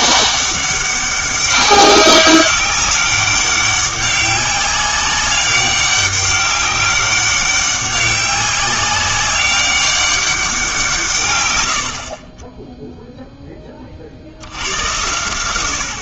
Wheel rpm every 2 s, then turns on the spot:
200, 200, 200, 200, 190, 180, 10, 90.
none